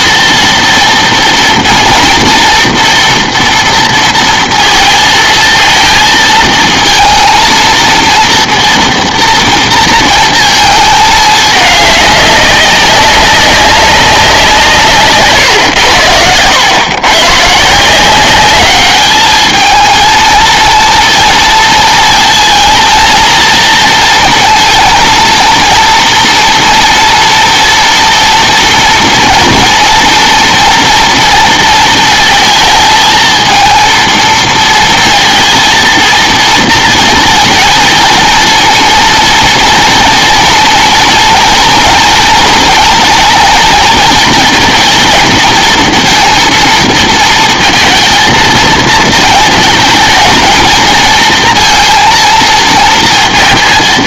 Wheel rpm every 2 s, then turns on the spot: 230, 230, 230, 230, 230, 220, 200, 160, 120, 210, 230, 230, 230, 230, 240, 230, 220, 230, 230, 230, 230, 230, 230, 230, 220, 230, 230.
none